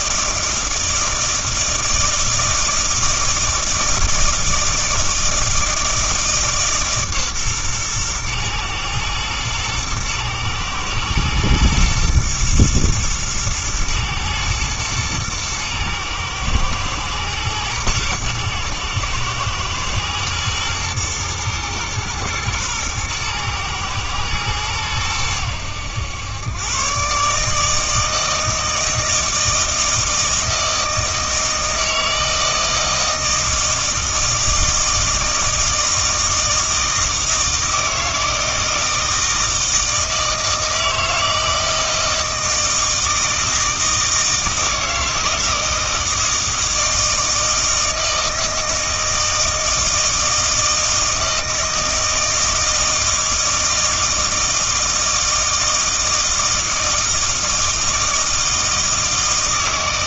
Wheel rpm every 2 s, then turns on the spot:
160, 160, 160, 150, 110, 110, 110, 110, 110, 110, 110, 110, 110, 120, 160, 160, 160, 160, 160, 160, 160, 160, 160, 160, 160, 160, 160, 160, 160, 160.
none